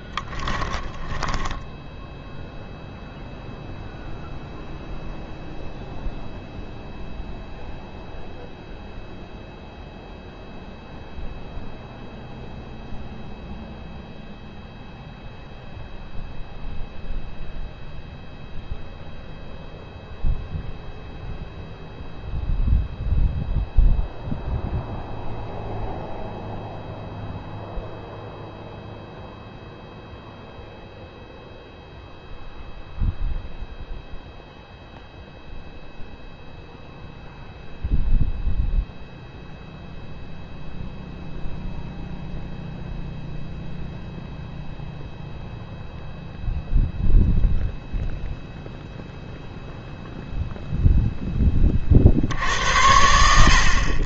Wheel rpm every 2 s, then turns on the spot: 10, 0, 0, 0, 0, 0, 0, 0, 0, 0, 0, 0, 0, 0, 0, 0, 0, 0, 0, 0, 0, 0, 0, 0, 0, 0, 90.
0-2